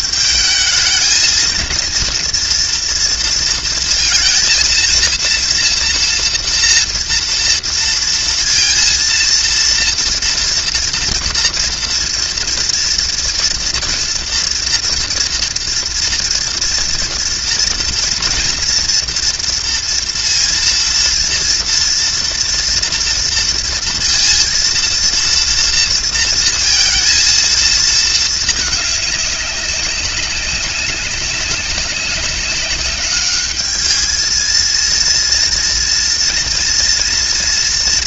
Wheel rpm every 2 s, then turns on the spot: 220, 240, 230, 230, 230, 230, 230, 230, 230, 230, 230, 230, 230, 230, 210, 190, 190, 230, 230.
none